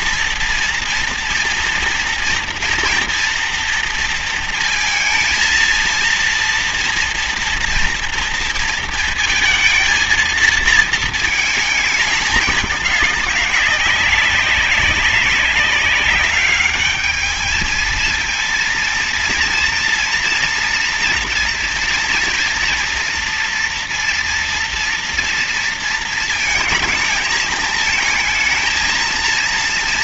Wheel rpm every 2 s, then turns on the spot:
230, 230, 230, 230, 230, 220, 210, 200, 210, 230, 230, 230, 230, 230, 220.
none